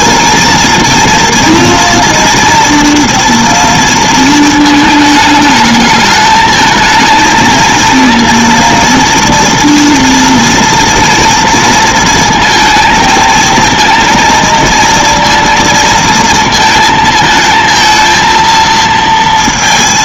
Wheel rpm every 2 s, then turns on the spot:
230, 230, 220, 220, 230, 240, 230, 230, 230, 230.
none